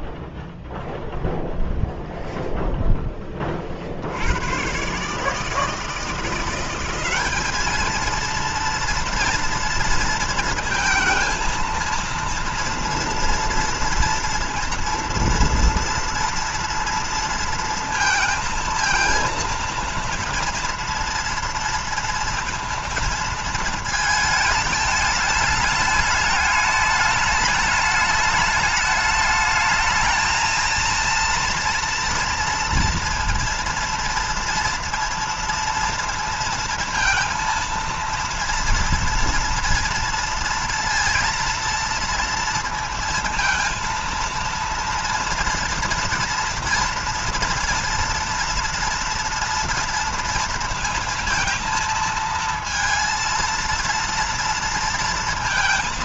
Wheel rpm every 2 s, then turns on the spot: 0, 0, 110, 180, 230, 230, 230, 230, 230, 230, 230, 230, 220, 210, 210, 230, 230, 230, 230, 230, 230, 230, 230, 230, 230, 230, 230, 230.
none